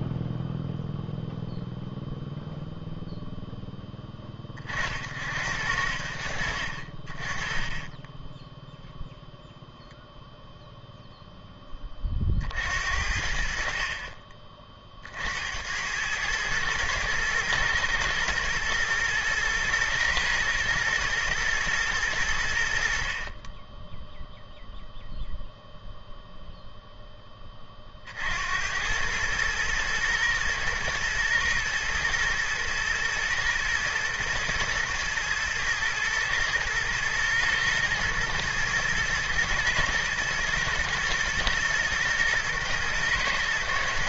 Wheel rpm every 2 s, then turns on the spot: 0, 0, 30, 50, 0, 0, 60, 30, 110, 110, 110, 50, 0, 0, 90, 110, 110, 110, 110, 110, 110, 120.
none